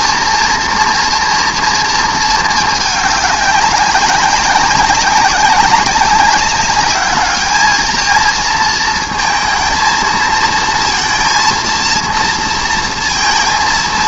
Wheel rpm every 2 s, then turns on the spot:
230, 220, 190, 200, 220, 230, 230.
none